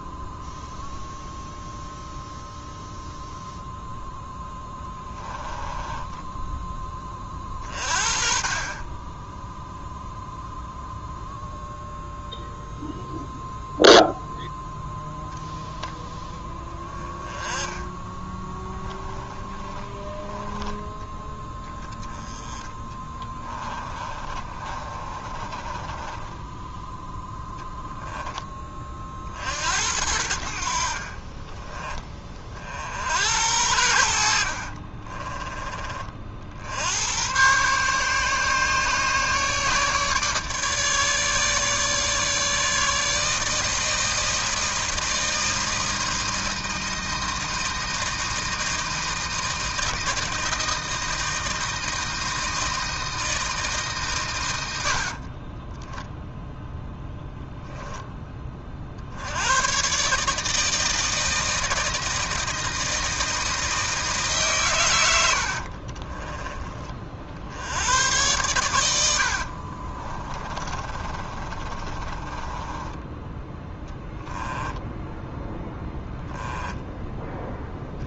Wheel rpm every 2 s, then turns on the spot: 0, 0, 10, 10, 30, 0, 0, 10, 10, 10, 10, 10, 30, 10, 20, 60, 50, 50, 70, 150, 150, 150, 160, 160, 160, 160, 160, 80, 0, 30, 160, 160, 130, 20, 100, 30, 20, 0, 10.
4-6 18-20 22-28 34-36 70-74 76-78